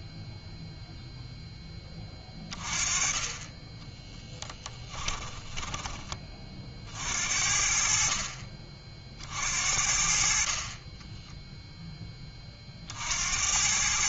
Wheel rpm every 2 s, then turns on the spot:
0, 20, 10, 40, 50, 40, 40.
4-6